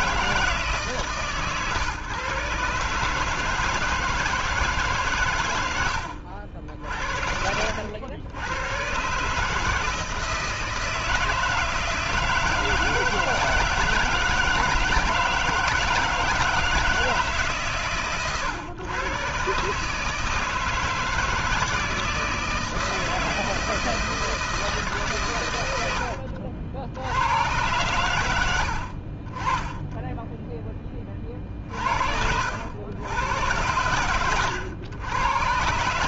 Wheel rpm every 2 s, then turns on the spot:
130, 150, 130, 60, 140, 160, 160, 160, 150, 130, 160, 160, 150, 70, 70, 10, 100, 100.
none